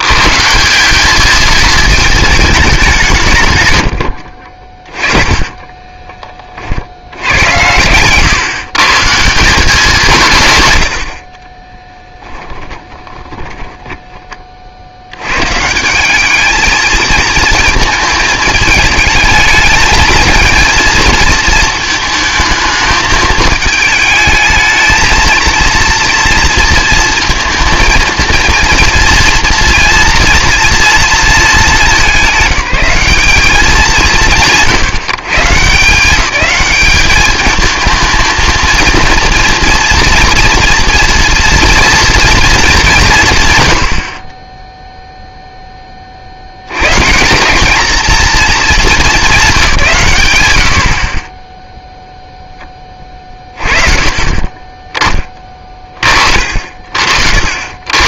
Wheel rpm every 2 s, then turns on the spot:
190, 200, 40, 50, 140, 100, 10, 60, 220, 220, 230, 220, 220, 230, 230, 240, 210, 150, 210, 230, 230, 220, 0, 100, 200, 80, 10, 10, 50.
4-6 12-14